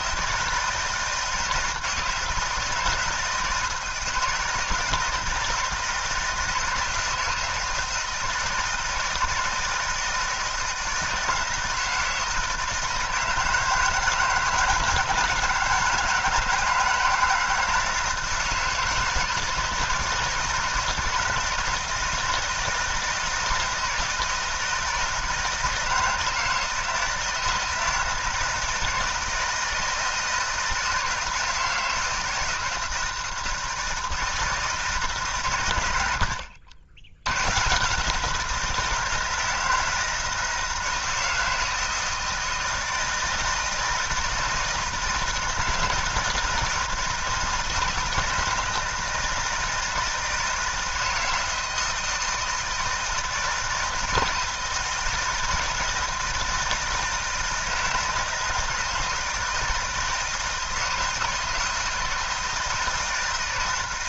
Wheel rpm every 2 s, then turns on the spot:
160, 160, 170, 160, 160, 160, 160, 160, 160, 160, 160, 160, 160, 160, 160, 160, 160, 160, 70, 170, 160, 160, 160, 160, 160, 160, 160, 160, 160, 160, 160, 160.
none